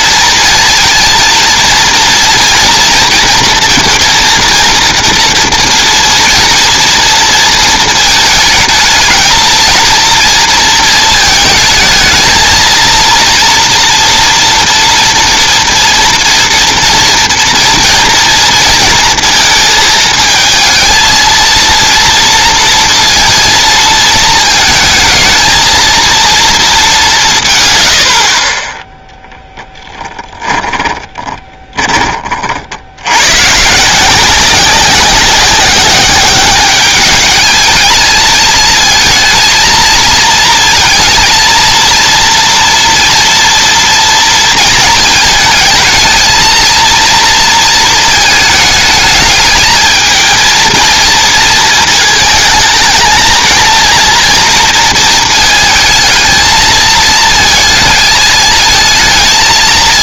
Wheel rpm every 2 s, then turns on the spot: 230, 240, 230, 230, 220, 230, 230, 240, 230, 230, 220, 230, 220, 220, 20, 20, 60, 190, 200, 220, 230, 230, 230, 230, 220, 230, 220, 230, 220, 220.
30-32